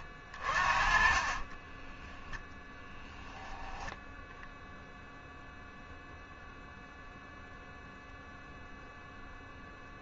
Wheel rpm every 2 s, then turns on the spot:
30, 10, 0, 0, 0.
0-2